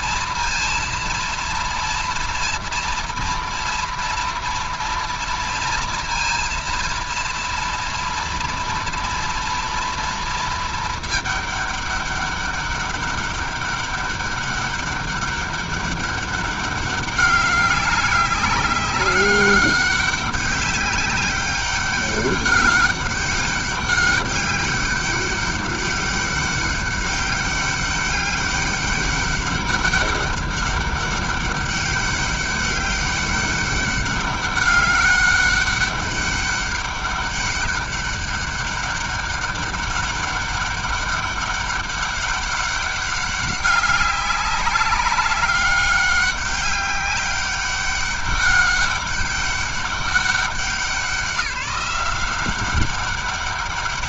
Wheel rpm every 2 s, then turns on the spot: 230, 230, 230, 230, 230, 220, 200, 200, 200, 200, 200, 200, 200, 200, 200, 200, 200, 200, 200, 200, 200, 200, 200, 200, 200, 190, 190.
none